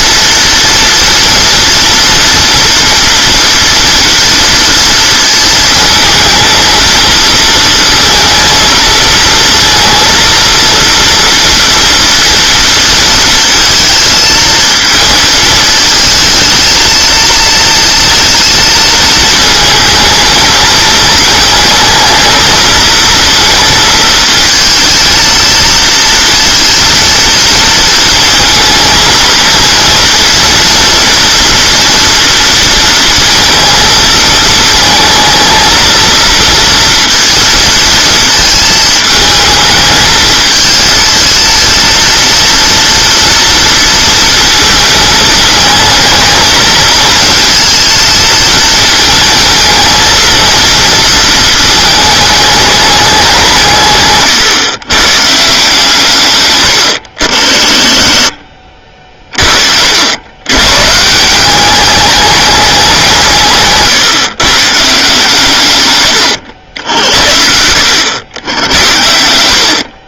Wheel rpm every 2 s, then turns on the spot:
230, 230, 230, 230, 230, 230, 230, 220, 220, 230, 220, 220, 230, 230, 220, 230, 230, 220, 230, 220, 220, 230, 220, 220, 220, 230, 200, 120, 110, 40, 130, 200, 150, 90, 90.
56-60